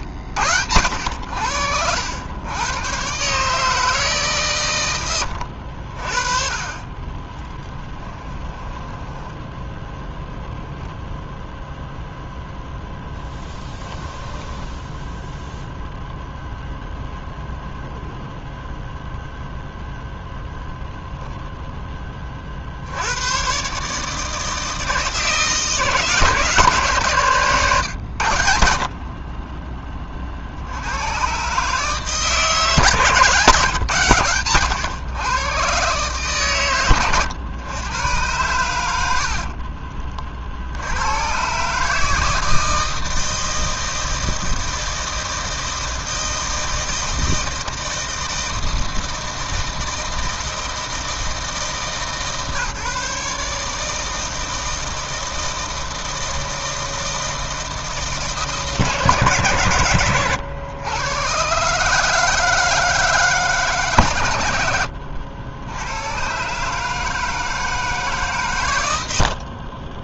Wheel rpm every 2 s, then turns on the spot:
90, 120, 120, 30, 10, 20, 0, 0, 0, 0, 0, 80, 160, 150, 50, 90, 150, 120, 100, 80, 80, 160, 160, 160, 160, 160, 140, 160, 160, 150, 110, 150, 80, 150, 110.
8-12